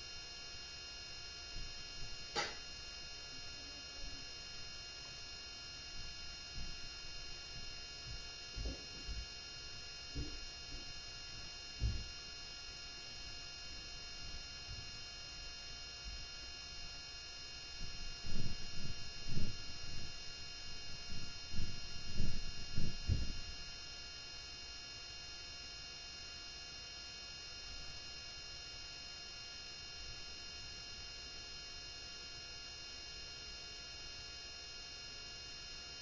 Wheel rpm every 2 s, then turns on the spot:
0, 0, 0, 0, 0, 0, 0, 0, 0, 0, 0, 0, 0, 0, 0, 0, 0, 0.
none